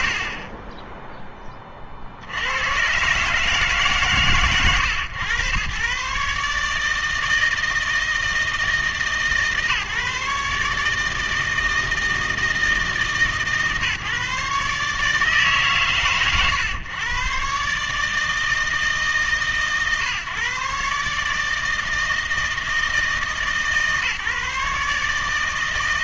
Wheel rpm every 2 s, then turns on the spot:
30, 120, 120, 150, 160, 150, 150, 150, 130, 150, 140, 160, 150.
0-2